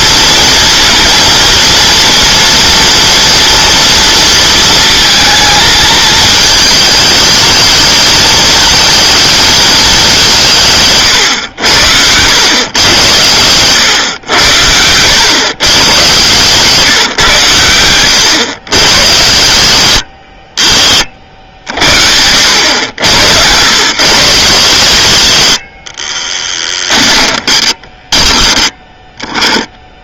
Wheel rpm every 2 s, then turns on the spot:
230, 230, 230, 210, 220, 140, 110, 90, 140, 120, 50, 90, 120, 10, 10.
26-28